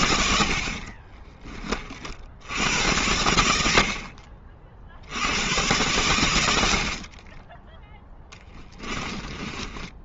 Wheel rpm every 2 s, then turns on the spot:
60, 80, 60, 60, 20.
0-2 8-10